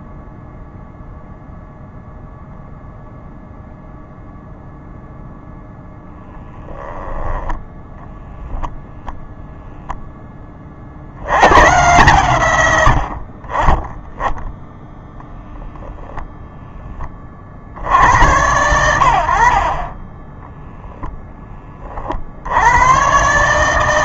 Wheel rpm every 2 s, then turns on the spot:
0, 0, 0, 10, 0, 60, 90, 0, 20, 90, 10, 110.
6-8